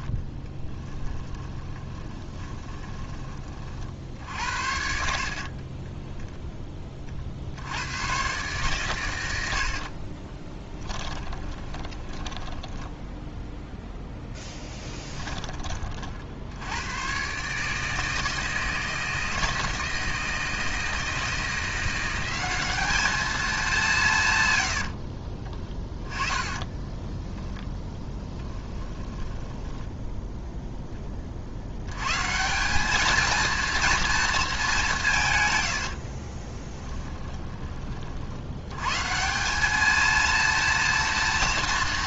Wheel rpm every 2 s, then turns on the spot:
10, 20, 60, 30, 110, 20, 10, 10, 110, 160, 160, 210, 70, 20, 10, 20, 200, 180, 10, 120, 230.
0-2 4-6 10-14 24-30 36-38